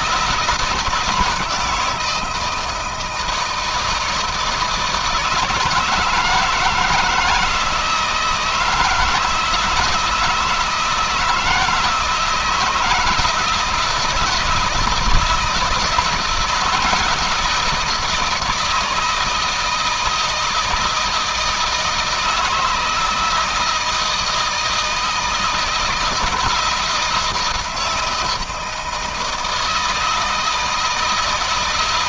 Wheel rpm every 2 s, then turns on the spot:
160, 160, 160, 160, 160, 160, 160, 160, 160, 160, 160, 160, 160, 170, 160, 160.
none